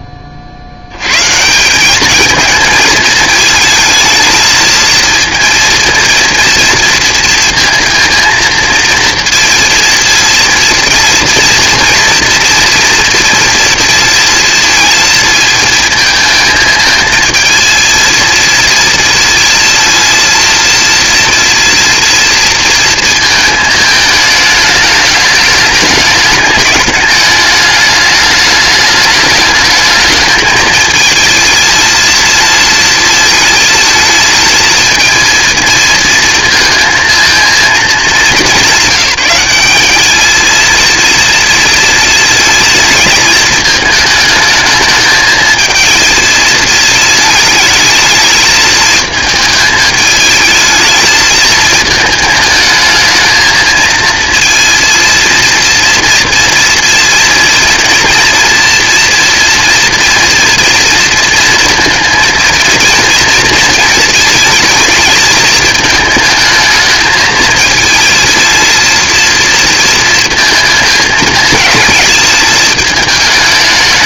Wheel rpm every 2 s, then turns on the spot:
90, 220, 220, 230, 230, 230, 230, 230, 220, 230, 230, 230, 210, 210, 210, 220, 220, 230, 230, 200, 230, 220, 220, 220, 220, 220, 220, 230, 230, 230, 230, 230, 220, 220, 230, 220, 220.
none